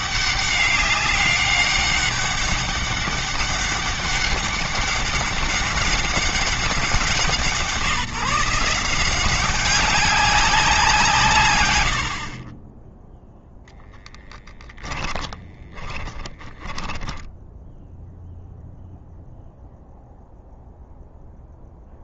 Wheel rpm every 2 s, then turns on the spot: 200, 200, 200, 180, 160, 180, 20, 10, 20, 0, 0.
14-18